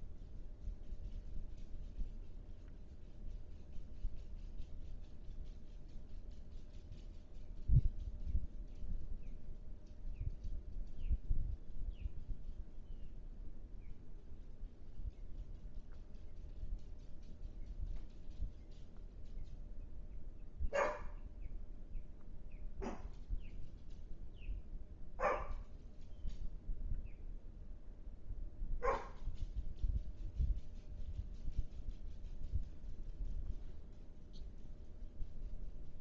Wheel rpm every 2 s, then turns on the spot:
0, 0, 0, 0, 0, 0, 0, 0, 0, 0, 0, 0, 0, 0, 0, 0, 0, 0.
none